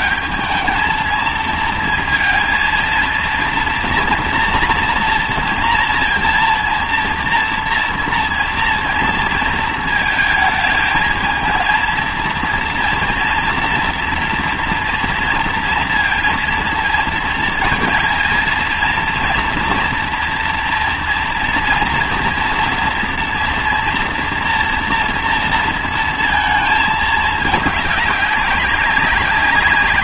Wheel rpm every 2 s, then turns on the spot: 220, 230, 230, 230, 230, 220, 230, 230, 230, 230, 240, 230, 230, 220, 200.
none